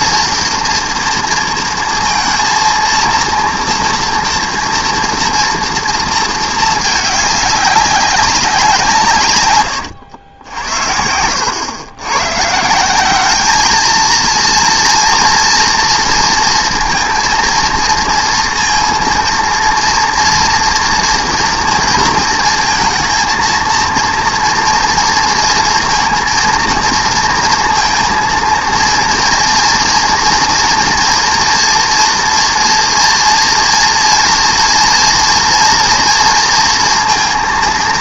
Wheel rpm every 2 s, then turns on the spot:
230, 230, 230, 210, 170, 70, 190, 230, 230, 230, 230, 230, 230, 230, 230, 230, 240, 230, 230.
none